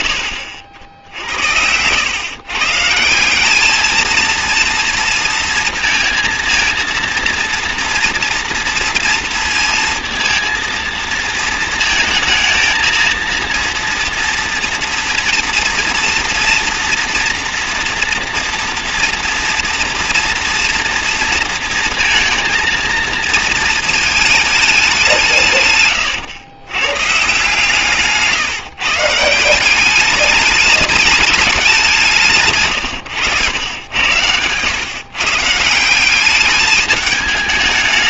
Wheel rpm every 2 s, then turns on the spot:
70, 150, 230, 230, 230, 230, 230, 230, 230, 230, 230, 230, 200, 140, 160, 210, 120, 130, 210.
none